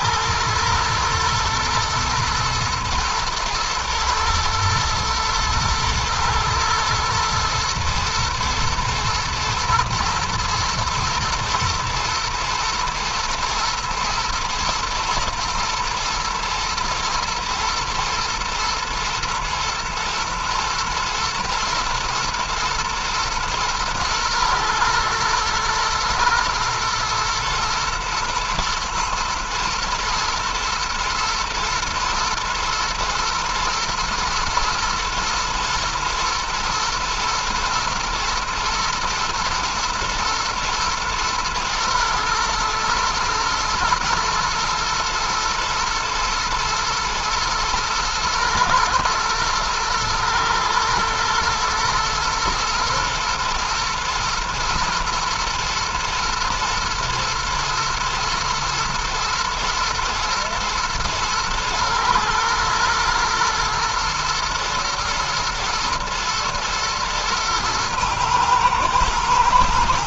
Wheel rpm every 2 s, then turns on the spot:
110, 120, 120, 110, 110, 120, 110, 110, 110, 110, 110, 120, 120, 120, 120, 110, 110, 110, 110, 120, 110, 110, 110, 110, 110, 110, 110, 120, 120, 110, 120, 110, 120, 120, 110.
none